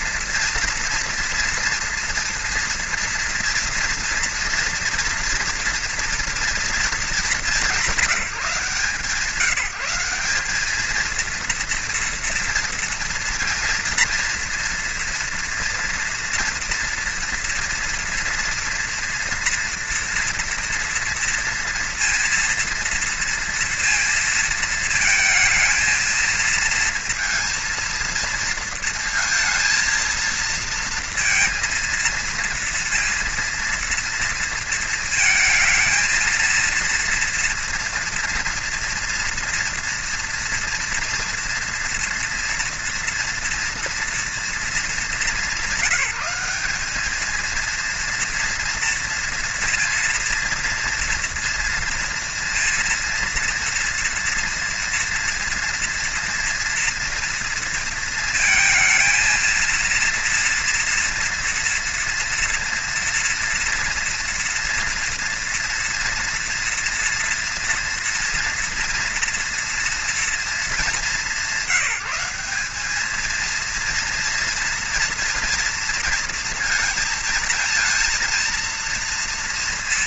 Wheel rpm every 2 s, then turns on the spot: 230, 230, 230, 220, 160, 200, 230, 230, 230, 230, 230, 230, 220, 220, 230, 230, 230, 230, 230, 230, 230, 230, 220, 200, 230, 230, 230, 230, 230, 230, 230, 230, 230, 230, 230, 220, 200, 230, 230, 230.
none